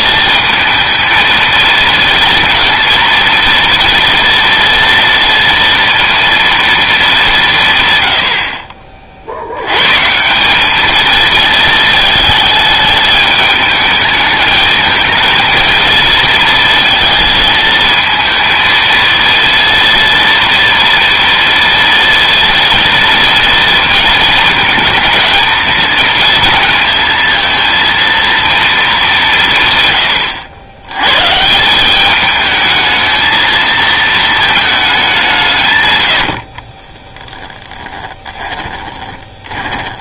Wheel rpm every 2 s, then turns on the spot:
220, 230, 230, 220, 50, 210, 210, 220, 230, 230, 230, 230, 220, 230, 220, 100, 220, 210, 40, 20.
36-40